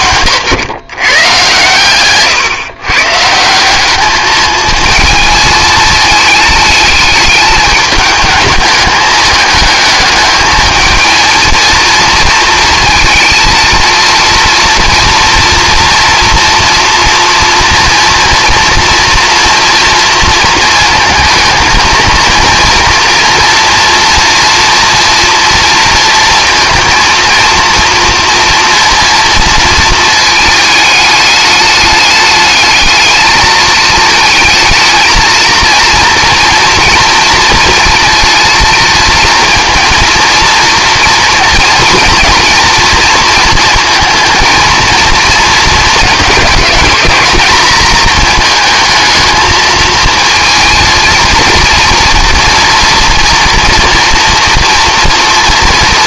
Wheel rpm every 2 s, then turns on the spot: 130, 120, 220, 220, 210, 220, 230, 230, 230, 240, 220, 230, 240, 230, 230, 210, 210, 220, 230, 220, 230, 220, 230, 220, 220, 230, 240, 230.
none